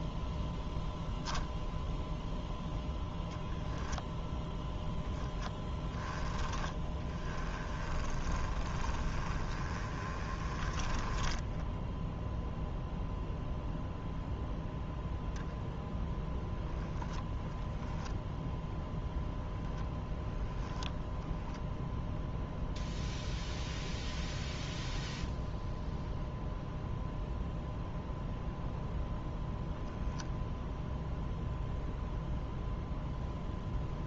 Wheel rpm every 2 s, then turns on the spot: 0, 0, 0, 10, 20, 10, 0, 0, 0, 0, 0, 0, 0, 0, 0, 0, 0.
6-12